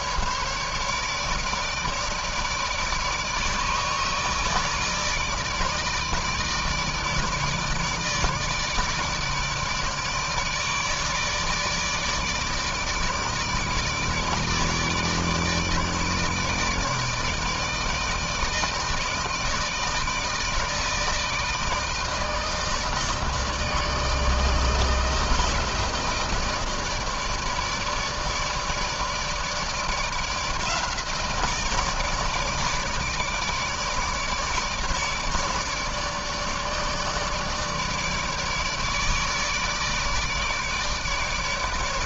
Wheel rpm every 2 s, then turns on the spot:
140, 150, 160, 160, 160, 150, 150, 150, 150, 150, 160, 160, 160, 160, 150, 160, 160, 150, 150, 150, 150.
none